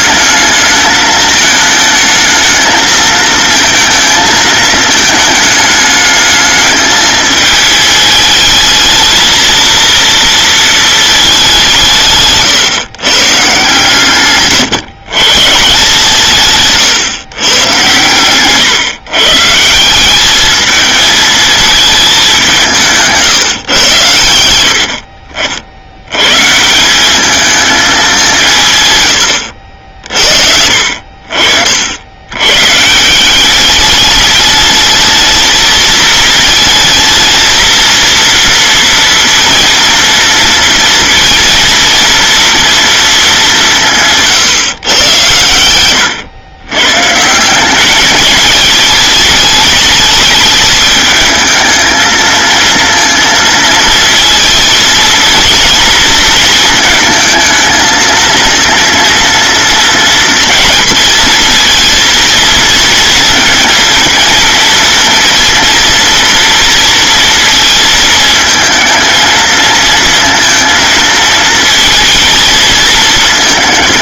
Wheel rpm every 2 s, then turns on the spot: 210, 220, 220, 210, 220, 220, 140, 130, 130, 130, 220, 170, 70, 170, 140, 60, 150, 220, 220, 230, 230, 230, 120, 130, 210, 220, 230, 230, 220, 230, 220, 230, 230, 230, 230, 230, 220.
none